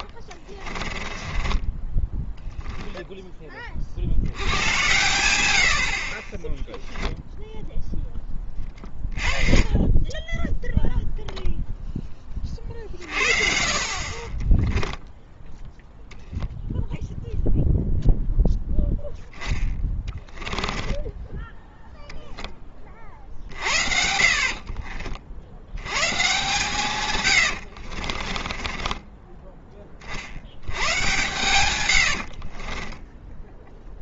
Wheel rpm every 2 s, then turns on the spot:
20, 10, 100, 0, 30, 10, 40, 10, 10, 0, 10, 20, 40, 140, 20, 90, 30.
0-4 14-16 20-22 24-26 28-30 32-34